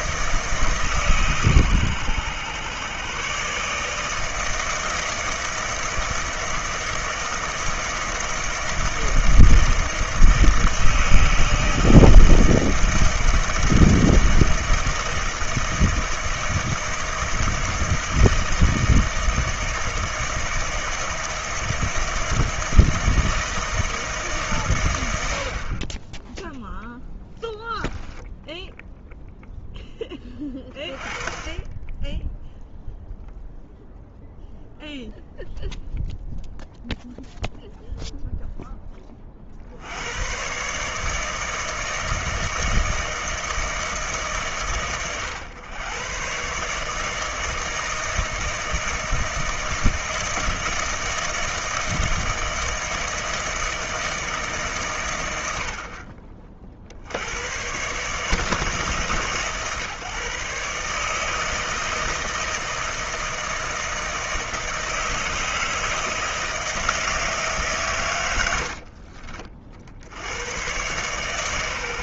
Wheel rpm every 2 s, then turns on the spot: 150, 120, 160, 160, 160, 160, 160, 160, 160, 160, 160, 160, 140, 10, 10, 20, 0, 0, 0, 10, 130, 160, 130, 140, 160, 160, 160, 140, 50, 140, 140, 160, 160, 160, 90, 110.
28-30 68-70